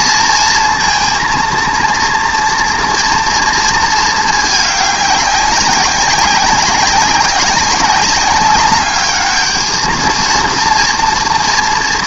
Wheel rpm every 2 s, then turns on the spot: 230, 240, 210, 190, 200, 230.
none